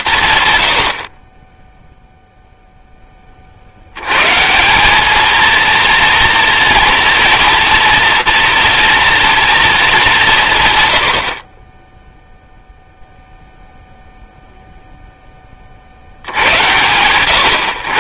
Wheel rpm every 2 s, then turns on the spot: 40, 10, 200, 230, 230, 100, 0, 0, 120.
none